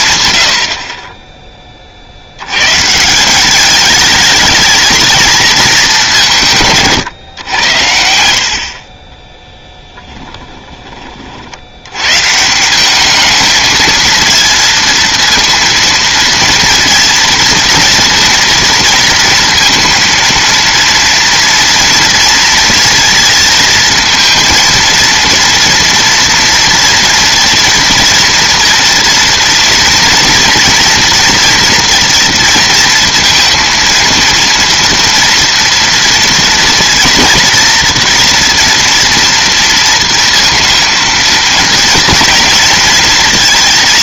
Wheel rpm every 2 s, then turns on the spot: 20, 130, 220, 150, 40, 20, 180, 230, 230, 230, 230, 230, 230, 240, 230, 230, 230, 230, 230, 240, 230, 230.
none